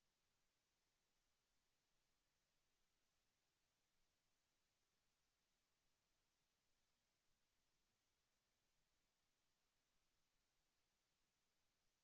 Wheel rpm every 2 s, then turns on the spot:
0, 0, 0, 0, 0, 0.
none